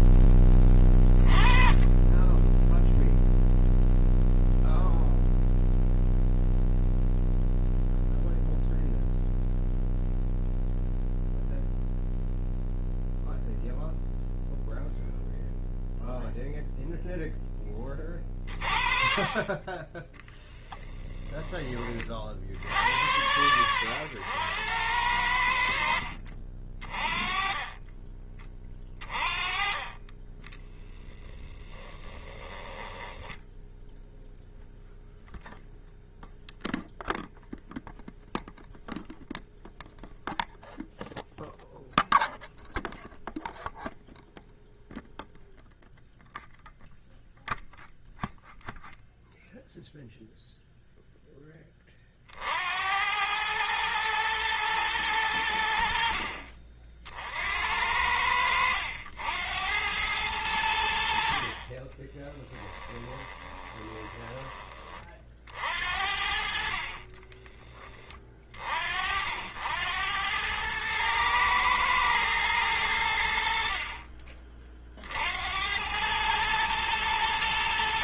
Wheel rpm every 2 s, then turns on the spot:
30, 0, 0, 0, 0, 0, 0, 0, 0, 40, 10, 80, 90, 30, 30, 20, 10, 0, 0, 0, 0, 0, 0, 0, 0, 0, 90, 110, 50, 80, 60, 10, 30, 30, 60, 110, 90, 50, 100.
20-22 30-34 62-64 66-68